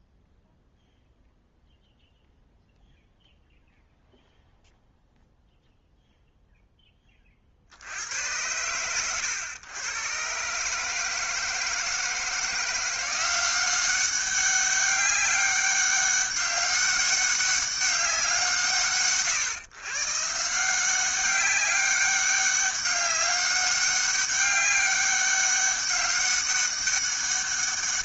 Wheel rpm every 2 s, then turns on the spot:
0, 0, 0, 0, 90, 130, 170, 200, 200, 180, 150, 200, 200, 200.
none